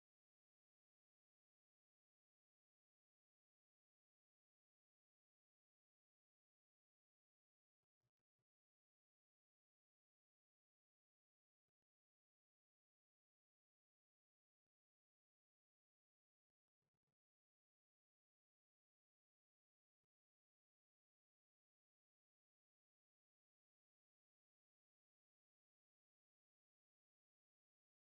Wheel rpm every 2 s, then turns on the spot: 0, 0, 0, 0, 0, 0, 0, 0, 0, 0, 0, 0, 0, 0.
none